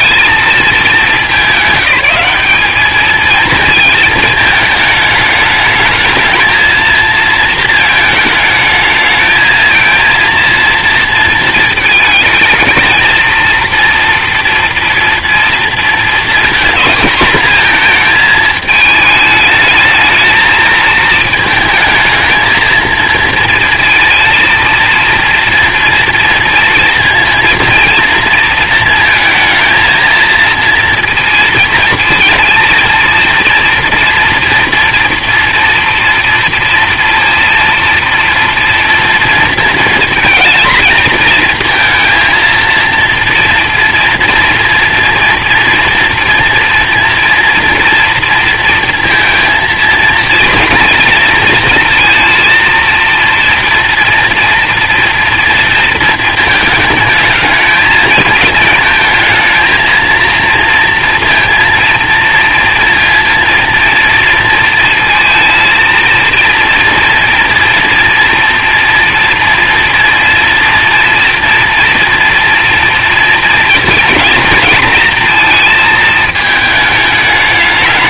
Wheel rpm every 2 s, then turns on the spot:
220, 200, 220, 220, 220, 230, 230, 230, 230, 220, 220, 220, 230, 230, 230, 230, 230, 230, 230, 230, 230, 230, 230, 230, 230, 230, 230, 230, 220, 220, 230, 230, 230, 230, 230, 240, 230, 230, 220.
none